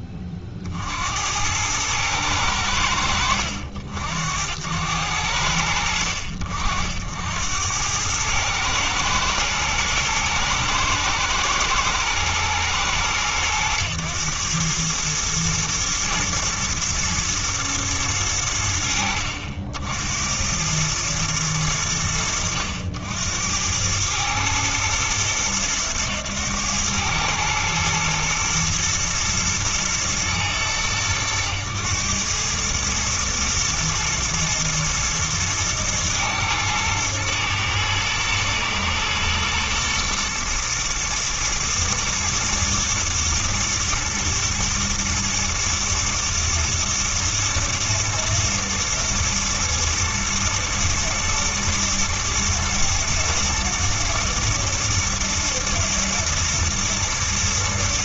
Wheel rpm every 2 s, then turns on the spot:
30, 80, 90, 70, 110, 110, 110, 110, 120, 50, 110, 80, 110, 110, 110, 100, 110, 120, 110, 110, 120, 120, 110, 110, 110, 120, 120, 110, 110.
none